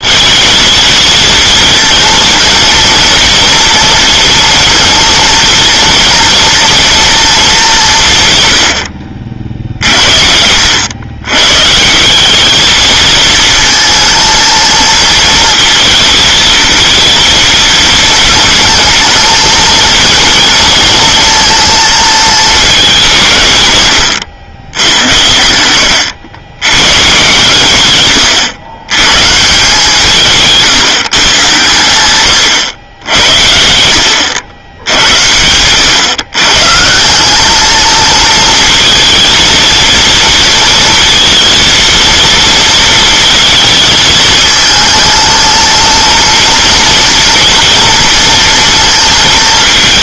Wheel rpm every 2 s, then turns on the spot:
220, 230, 230, 230, 80, 90, 220, 230, 230, 220, 230, 210, 90, 100, 120, 150, 100, 90, 140, 230, 230, 230, 220, 230, 230.
none